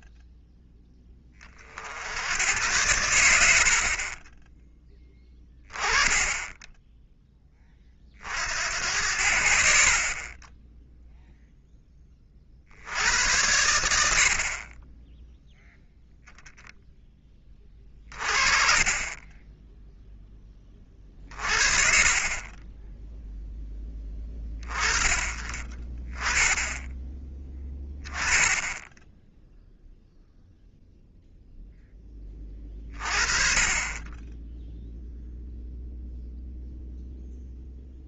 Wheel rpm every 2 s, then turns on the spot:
10, 100, 10, 20, 80, 0, 90, 20, 10, 20, 30, 10, 20, 20, 10, 0, 30, 0, 0.
none